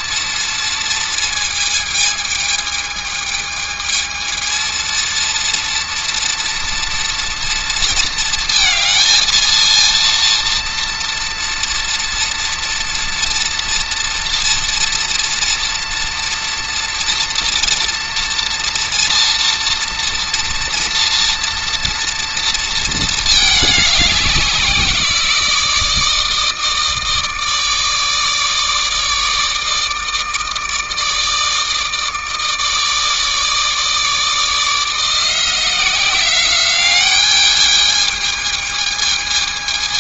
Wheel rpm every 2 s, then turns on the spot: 230, 220, 230, 240, 230, 230, 230, 230, 230, 230, 240, 220, 180, 160, 160, 160, 160, 160, 200, 220.
none